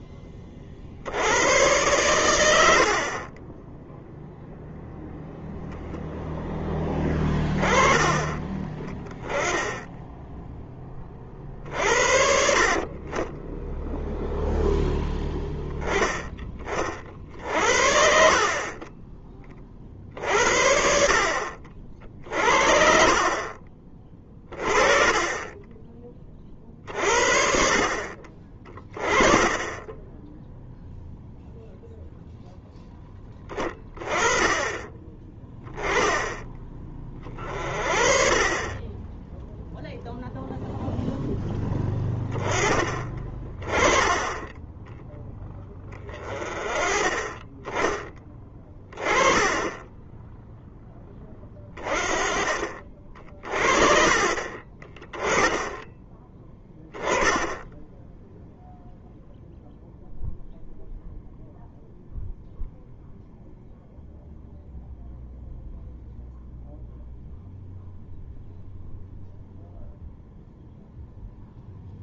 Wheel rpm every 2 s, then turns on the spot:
30, 90, 0, 10, 20, 0, 60, 0, 20, 40, 50, 50, 30, 30, 30, 0, 0, 20, 20, 30, 0, 20, 10, 30, 20, 10, 40, 30, 10, 0, 0, 0, 0, 0, 0, 0.
48-50